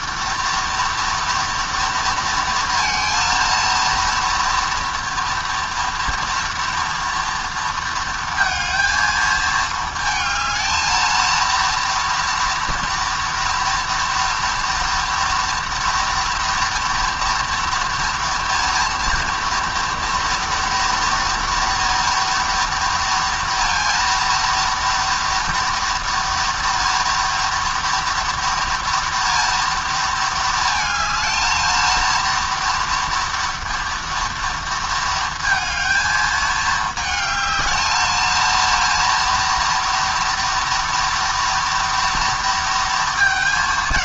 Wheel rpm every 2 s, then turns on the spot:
230, 230, 240, 230, 230, 220, 230, 230, 230, 230, 240, 230, 230, 230, 230, 220, 230, 230, 220, 230, 230, 230.
none